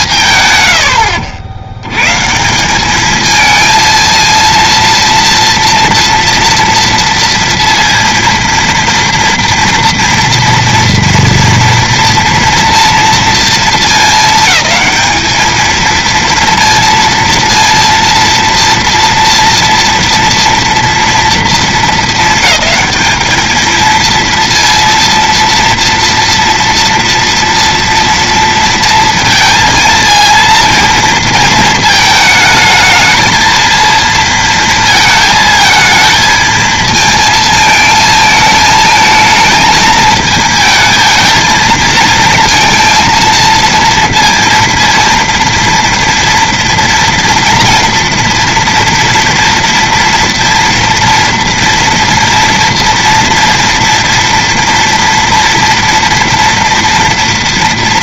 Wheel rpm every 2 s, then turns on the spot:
120, 170, 230, 230, 230, 230, 230, 220, 230, 230, 230, 210, 230, 230, 230, 230, 220, 220, 220, 220, 220, 230, 230, 230, 240, 230, 230, 230, 230.
none